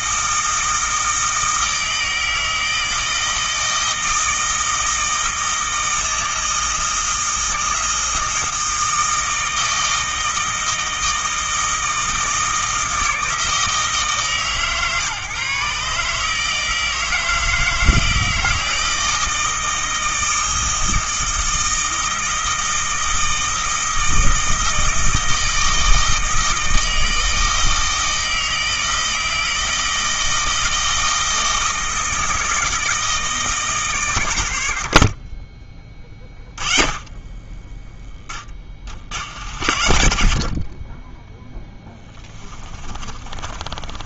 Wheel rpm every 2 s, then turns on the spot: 160, 160, 160, 160, 160, 160, 160, 130, 160, 160, 160, 160, 160, 160, 160, 160, 160, 120, 20, 20, 50, 20.
42-44